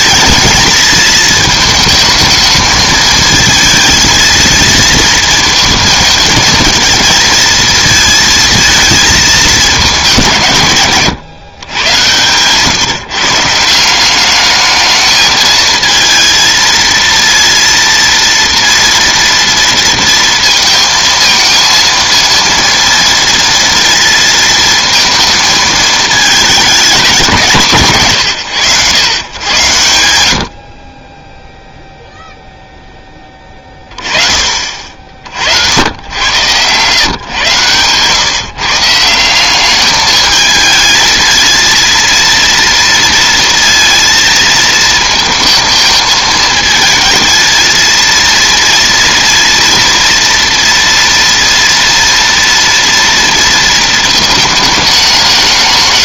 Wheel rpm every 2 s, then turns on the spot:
220, 220, 220, 230, 230, 140, 140, 210, 230, 230, 230, 230, 230, 210, 120, 40, 10, 40, 120, 160, 220, 230, 220, 220, 230, 230, 230, 210.
none